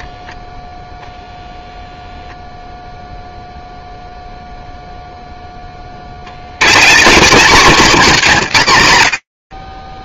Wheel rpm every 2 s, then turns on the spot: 0, 0, 20, 210, 40.
none